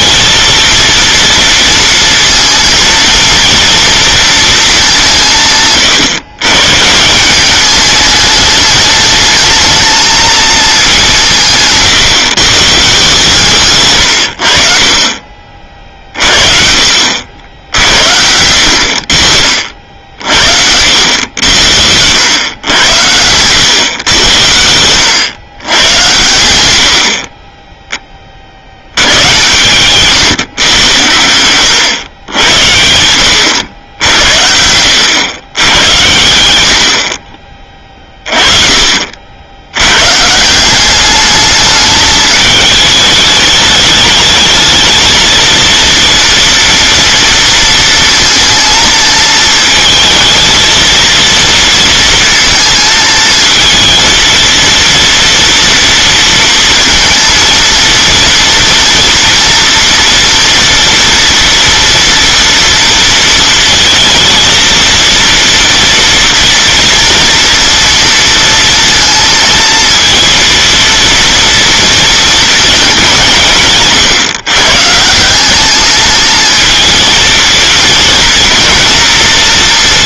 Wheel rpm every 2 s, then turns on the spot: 230, 230, 200, 130, 210, 210, 140, 50, 60, 70, 70, 100, 90, 70, 70, 120, 90, 80, 80, 40, 190, 220, 220, 230, 230, 230, 220, 230, 230, 230, 230, 230, 230, 230, 230, 230, 210, 140, 230, 230.
26-28